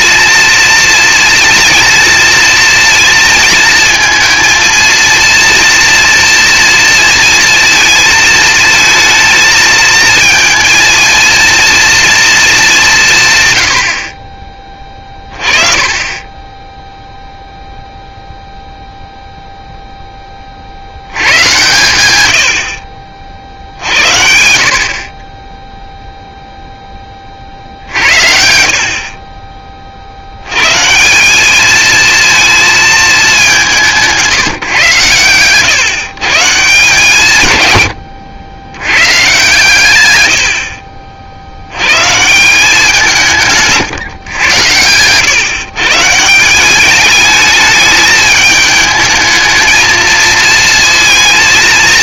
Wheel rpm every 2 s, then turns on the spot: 230, 230, 230, 230, 220, 220, 210, 30, 10, 0, 30, 80, 60, 0, 60, 120, 230, 160, 150, 100, 60, 180, 100, 190, 220, 230.
16-18 40-42